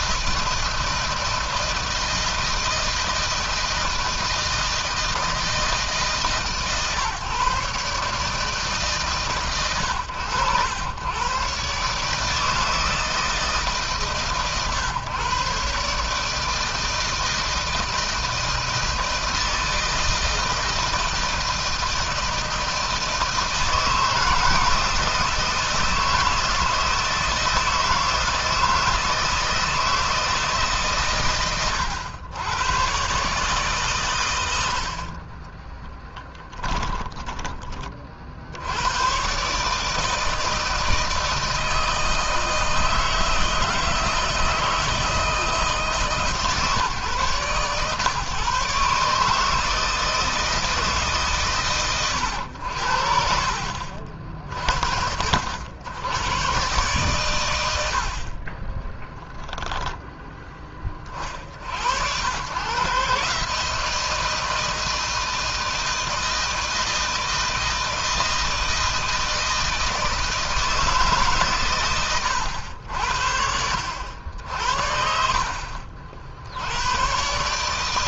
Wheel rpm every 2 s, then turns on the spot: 160, 160, 160, 150, 140, 110, 160, 130, 160, 160, 160, 160, 160, 160, 160, 140, 130, 60, 10, 100, 160, 160, 160, 130, 140, 160, 70, 70, 120, 10, 30, 140, 160, 160, 160, 150, 70, 50, 100.
36-38 58-60